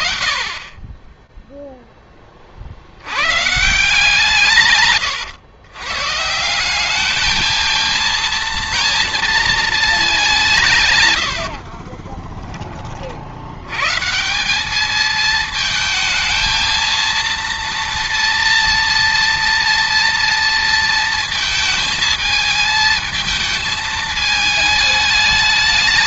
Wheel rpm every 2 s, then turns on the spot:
40, 130, 180, 230, 160, 20, 190, 230, 230, 230, 220, 210, 220.
none